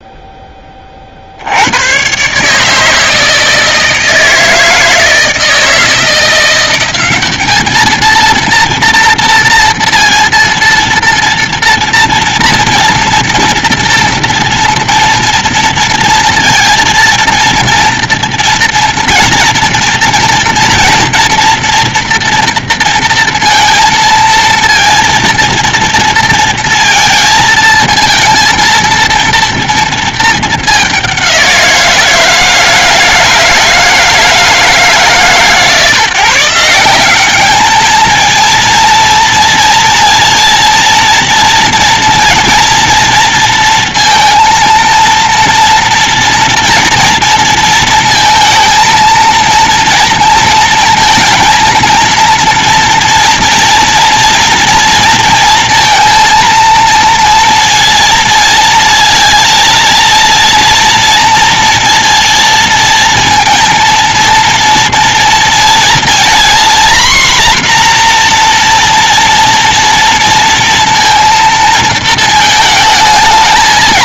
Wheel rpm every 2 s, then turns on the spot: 10, 130, 160, 170, 230, 230, 230, 230, 230, 240, 240, 240, 230, 230, 230, 220, 160, 160, 160, 230, 230, 230, 230, 240, 230, 230, 230, 230, 230, 230, 230, 230, 240, 240, 240, 230, 220.
none